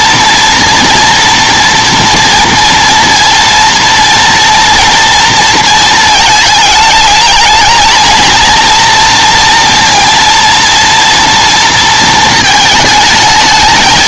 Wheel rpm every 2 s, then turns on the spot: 230, 230, 230, 220, 230, 230, 220.
none